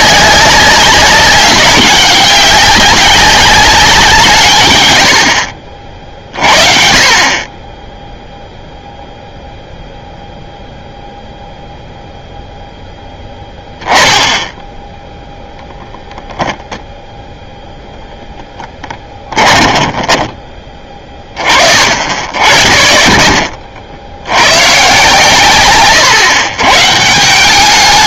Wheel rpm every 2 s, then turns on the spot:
200, 200, 120, 40, 0, 0, 0, 10, 0, 10, 20, 60, 120, 130.
18-20